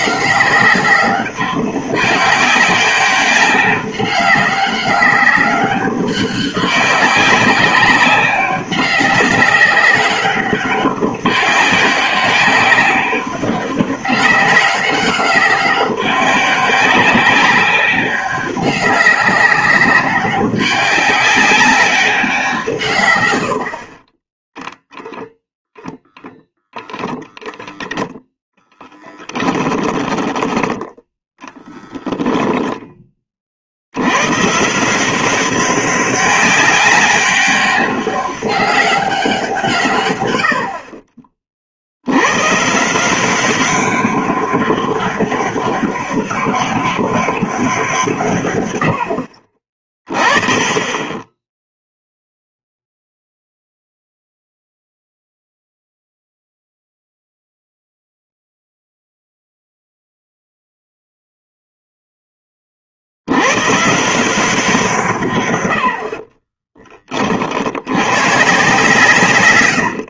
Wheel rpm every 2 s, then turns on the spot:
190, 200, 200, 200, 190, 190, 190, 200, 200, 200, 200, 160, 10, 0, 0, 10, 10, 140, 200, 200, 80, 120, 200, 200, 120, 30, 0, 0, 0, 0, 0, 30, 170, 30, 140.
66-68